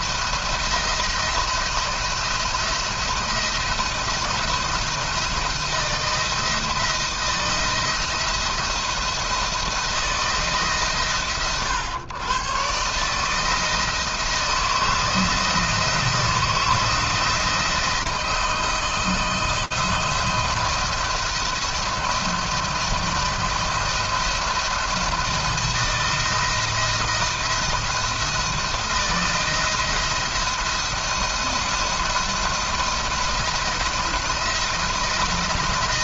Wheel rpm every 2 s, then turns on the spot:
170, 170, 160, 170, 170, 140, 150, 160, 170, 160, 170, 170, 170, 160, 170, 170, 170, 170.
none